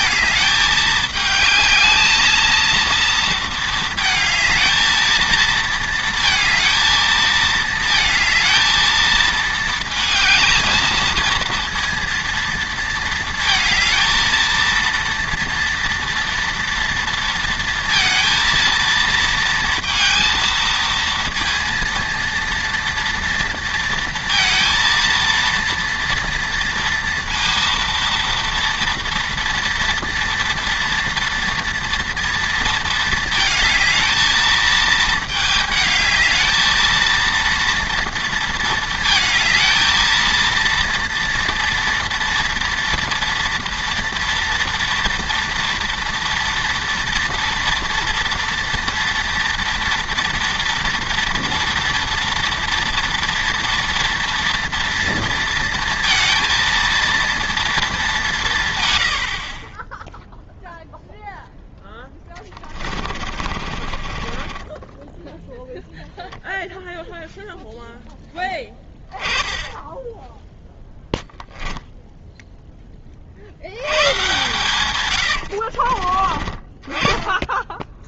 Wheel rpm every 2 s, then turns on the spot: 210, 230, 220, 220, 220, 220, 230, 230, 230, 230, 230, 230, 230, 230, 230, 230, 230, 220, 220, 230, 230, 240, 240, 230, 230, 230, 230, 230, 230, 160, 0, 20, 20, 0, 10, 10, 10, 120, 30.
62-66